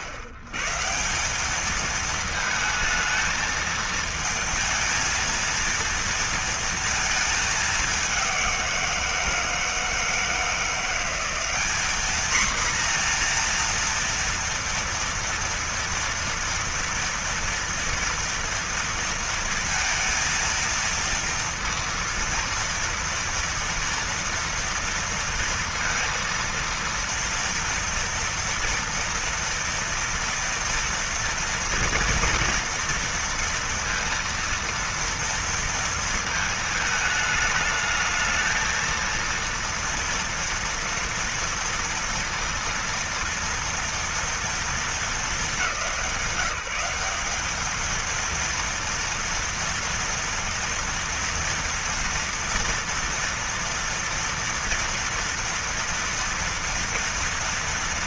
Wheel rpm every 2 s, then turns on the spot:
130, 220, 230, 230, 180, 170, 230, 230, 230, 230, 230, 230, 230, 230, 230, 230, 230, 230, 220, 220, 230, 230, 230, 180, 230, 230, 230, 230, 230.
none